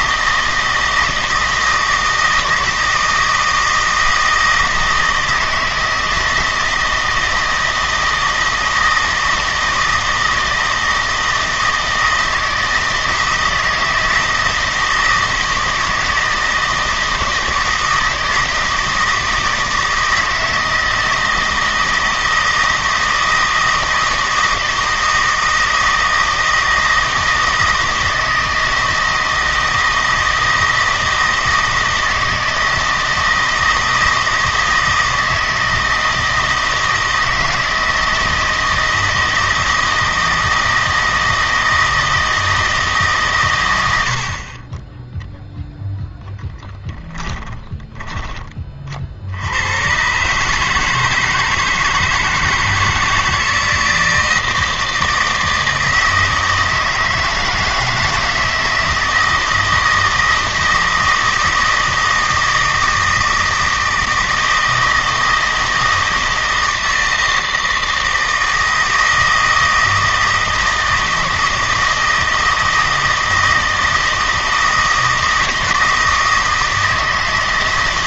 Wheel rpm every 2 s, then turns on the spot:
160, 160, 160, 160, 160, 160, 160, 160, 160, 160, 160, 170, 160, 160, 160, 160, 160, 160, 160, 160, 160, 160, 20, 10, 40, 150, 160, 160, 160, 160, 160, 160, 160, 160, 160, 160, 160, 160, 160.
46-48